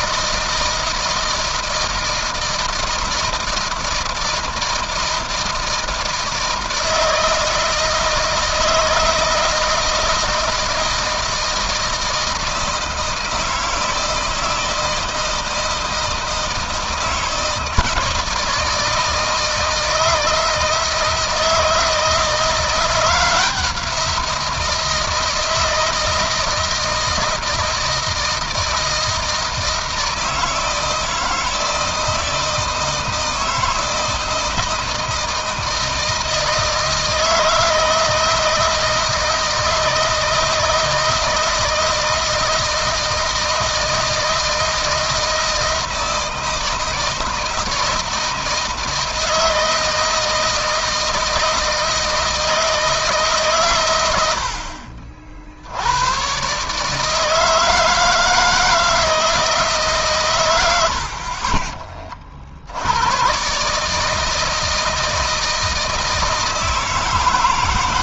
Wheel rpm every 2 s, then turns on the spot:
160, 160, 160, 160, 160, 160, 160, 160, 160, 160, 160, 170, 160, 160, 160, 160, 160, 160, 160, 160, 160, 160, 160, 160, 160, 160, 150, 50, 150, 160, 70, 90, 160, 160.
none